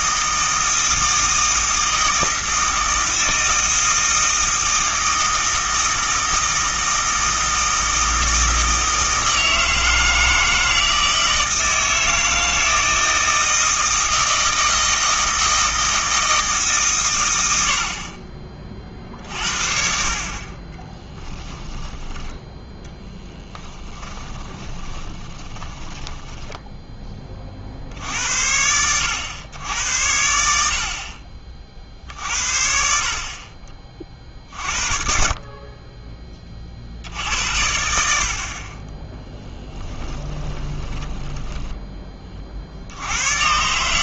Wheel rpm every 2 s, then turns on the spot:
160, 160, 160, 160, 160, 160, 160, 160, 150, 40, 20, 10, 20, 10, 80, 70, 50, 50, 50, 40, 10, 50.
24-26 40-42